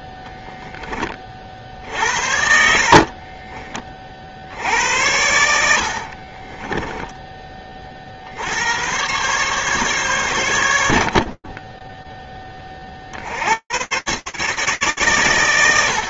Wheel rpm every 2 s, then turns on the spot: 0, 60, 60, 40, 70, 110, 40, 80.
2-4 6-8